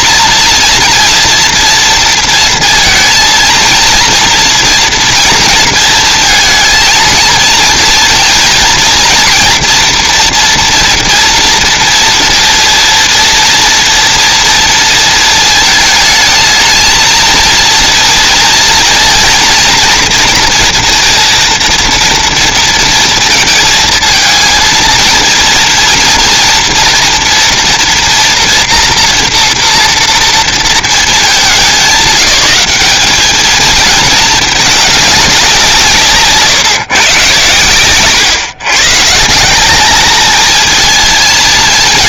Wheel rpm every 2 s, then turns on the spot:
230, 230, 230, 230, 230, 230, 230, 230, 220, 230, 230, 230, 220, 230, 230, 230, 200, 220, 150, 130, 220.
none